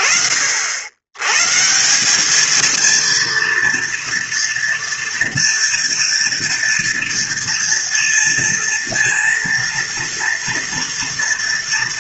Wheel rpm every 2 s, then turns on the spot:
100, 230, 230, 240, 230, 240.
none